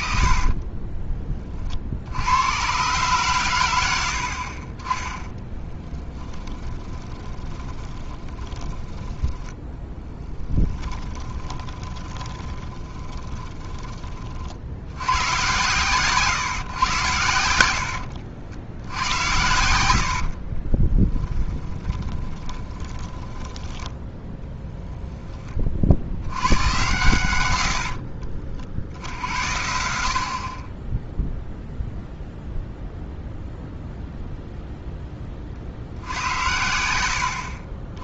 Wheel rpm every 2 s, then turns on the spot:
30, 120, 30, 20, 20, 10, 20, 80, 110, 90, 30, 10, 0, 100, 50, 20, 0, 0, 80.
0-2 6-14 20-24 36-38